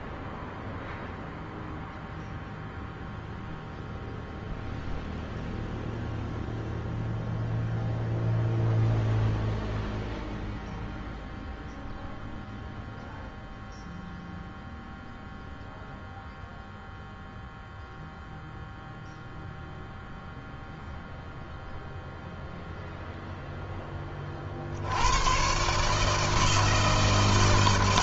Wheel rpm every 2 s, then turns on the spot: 0, 0, 0, 0, 0, 0, 0, 0, 0, 0, 0, 0, 50, 160.
none